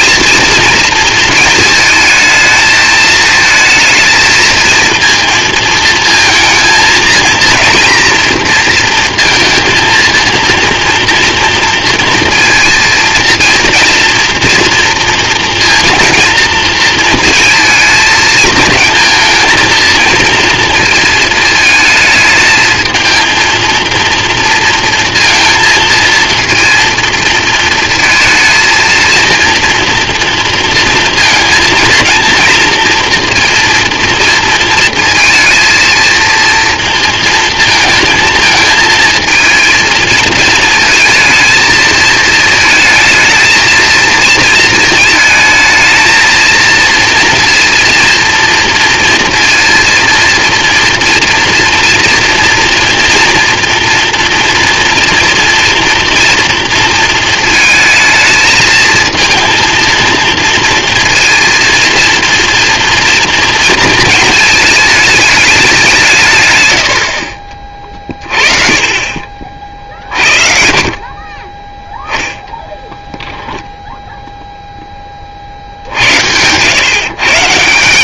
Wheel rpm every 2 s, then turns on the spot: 230, 220, 230, 220, 230, 230, 230, 230, 230, 230, 230, 220, 230, 230, 230, 230, 230, 220, 230, 230, 230, 230, 230, 230, 230, 230, 240, 230, 230, 220, 230, 230, 220, 110, 30, 50, 10, 10, 120.
72-74